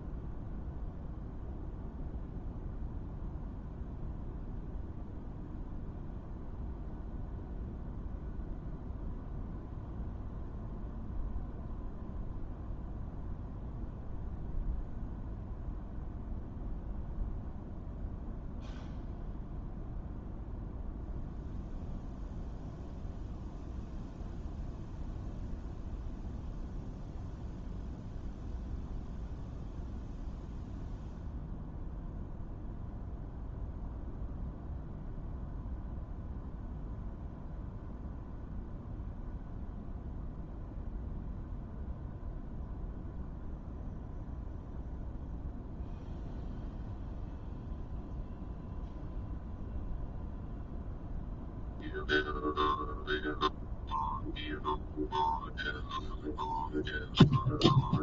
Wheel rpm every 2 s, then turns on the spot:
0, 0, 0, 0, 0, 0, 0, 0, 0, 0, 0, 0, 0, 0, 0, 0, 0, 0, 0, 0, 0, 0, 0, 0, 0, 0, 0, 0, 0.
none